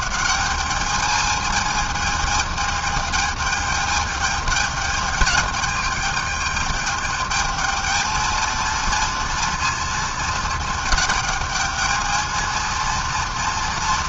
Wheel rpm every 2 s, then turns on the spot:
210, 220, 210, 210, 230, 220, 230.
none